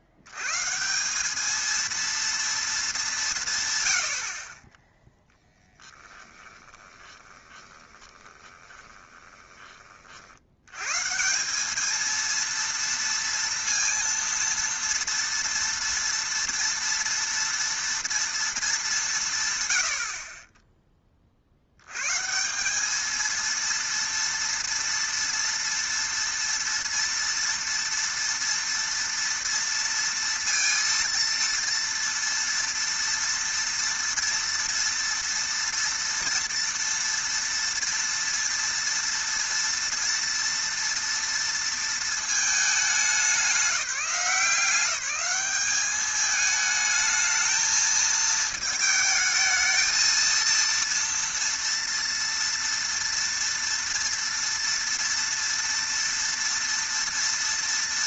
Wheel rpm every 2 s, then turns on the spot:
90, 230, 40, 20, 20, 90, 230, 230, 230, 220, 30, 170, 230, 230, 230, 230, 230, 230, 230, 230, 230, 210, 180, 220, 220, 230, 230, 230, 230.
6-10